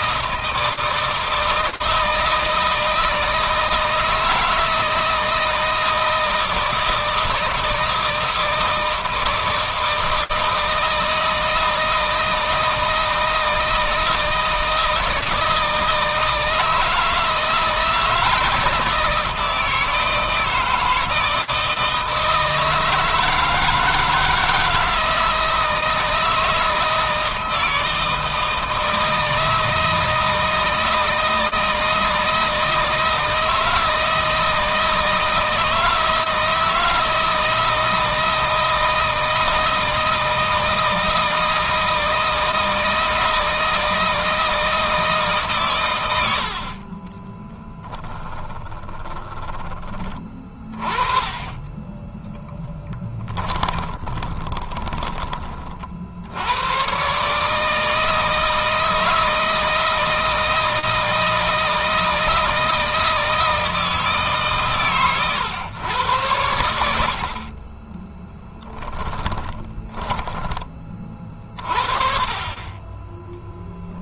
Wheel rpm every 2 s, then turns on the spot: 160, 160, 160, 160, 160, 160, 160, 160, 160, 170, 160, 160, 160, 160, 160, 160, 160, 160, 160, 160, 160, 160, 160, 40, 10, 30, 10, 20, 120, 160, 160, 160, 130, 80, 10, 30, 20.
46-50 52-56 68-70